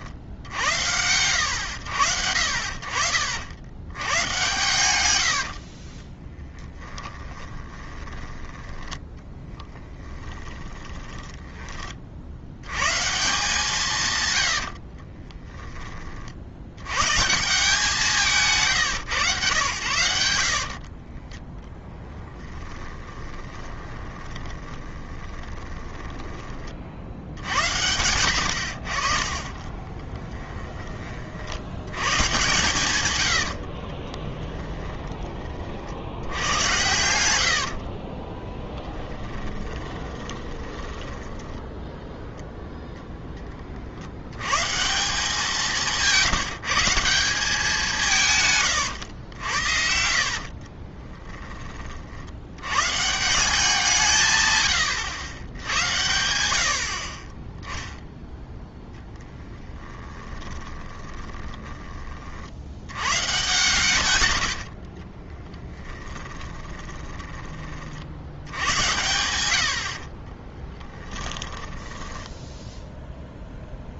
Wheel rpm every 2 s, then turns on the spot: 80, 50, 120, 10, 10, 20, 100, 80, 90, 150, 50, 20, 20, 40, 60, 20, 130, 10, 100, 10, 20, 0, 150, 170, 120, 30, 110, 110, 60, 0, 20, 80, 60, 20, 90, 20, 0.
4-8 10-12 14-16 20-26 34-36 38-42 48-52 60-62 64-68 70-72